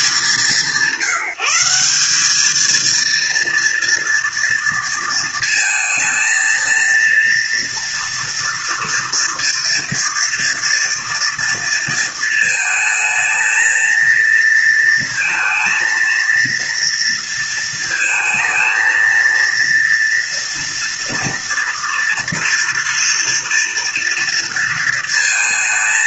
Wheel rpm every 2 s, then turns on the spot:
180, 230, 230, 230, 230, 230, 220, 230, 230, 230, 230, 230, 230.
none